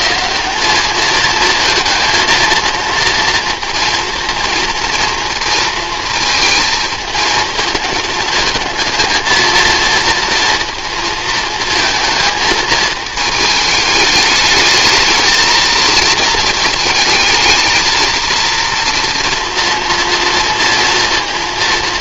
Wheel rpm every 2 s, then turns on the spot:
200, 230, 230, 220, 220, 230, 220, 220, 220, 230, 230.
none